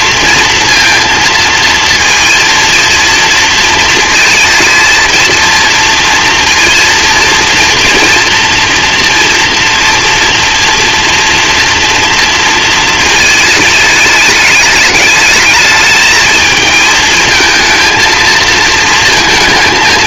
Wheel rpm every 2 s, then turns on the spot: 230, 230, 220, 230, 230, 240, 230, 210, 220, 230.
none